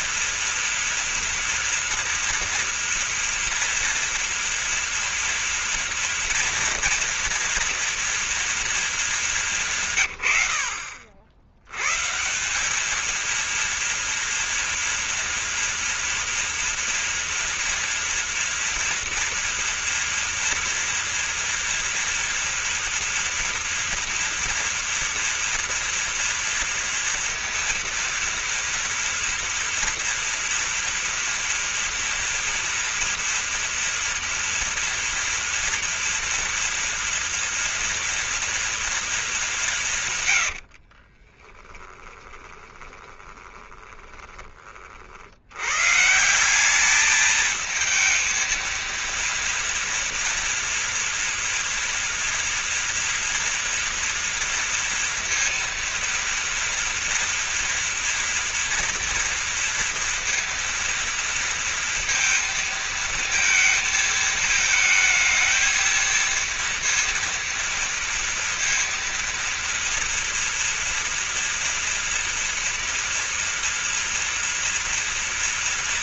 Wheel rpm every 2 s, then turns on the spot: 230, 230, 230, 230, 220, 60, 200, 230, 230, 240, 230, 230, 230, 230, 230, 230, 240, 230, 230, 230, 70, 20, 30, 200, 230, 230, 230, 230, 230, 230, 230, 230, 220, 230, 230, 240, 230, 230.
40-44